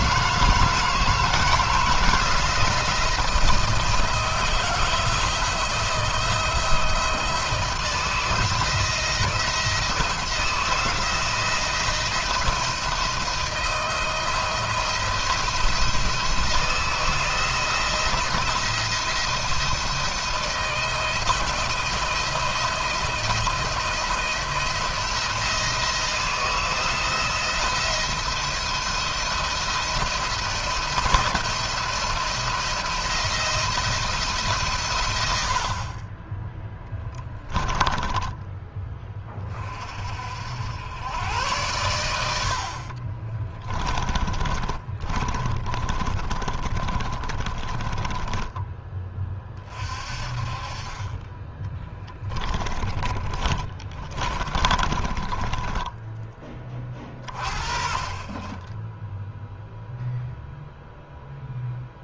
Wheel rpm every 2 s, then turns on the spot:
160, 170, 160, 160, 160, 170, 170, 170, 170, 170, 160, 170, 170, 160, 170, 160, 170, 140, 10, 20, 90, 50, 30, 30, 10, 30, 20, 20, 20, 10, 0.
36-38 42-48 52-56